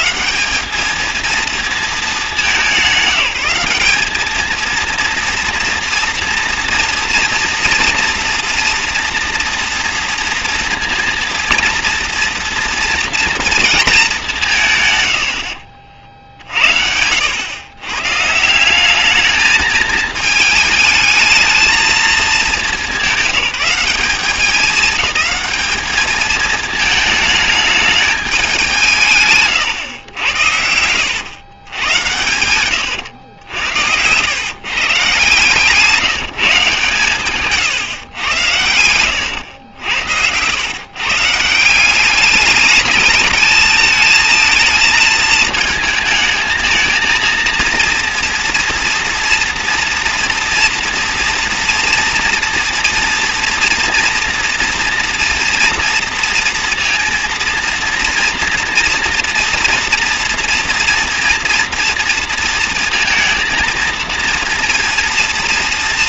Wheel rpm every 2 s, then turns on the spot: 200, 200, 230, 240, 230, 230, 230, 150, 70, 190, 220, 200, 210, 220, 180, 90, 110, 140, 150, 100, 130, 210, 230, 220, 230, 230, 230, 230, 230, 230, 230, 230, 230.
38-40